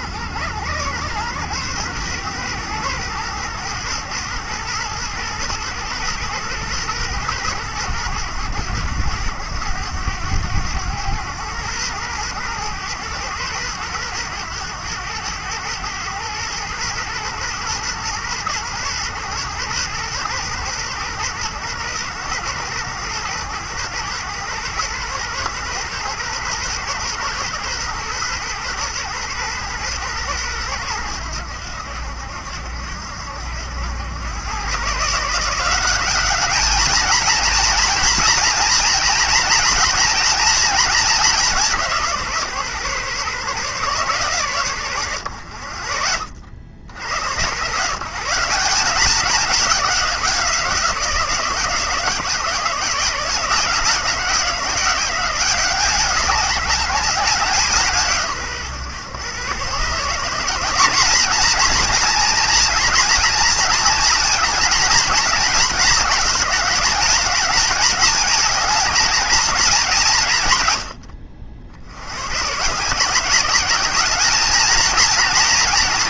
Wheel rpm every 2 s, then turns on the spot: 100, 110, 110, 110, 100, 100, 110, 110, 110, 110, 110, 110, 120, 120, 120, 110, 70, 120, 210, 230, 220, 140, 120, 80, 180, 170, 170, 180, 200, 120, 190, 230, 230, 210, 220, 110, 140, 220.
none